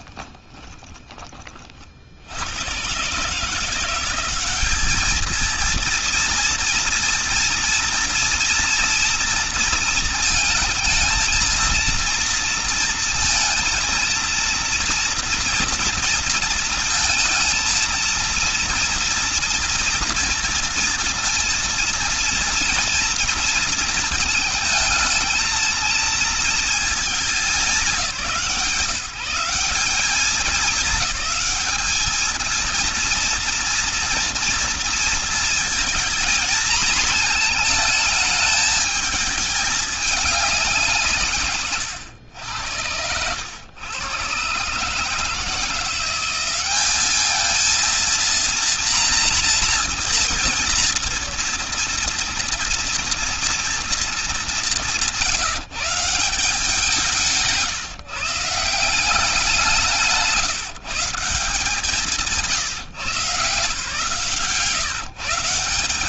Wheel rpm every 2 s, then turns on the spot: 30, 110, 210, 230, 230, 220, 230, 230, 220, 230, 230, 230, 220, 220, 170, 210, 230, 230, 220, 220, 170, 90, 130, 200, 230, 230, 230, 190, 160, 170, 160, 140, 150.
0-2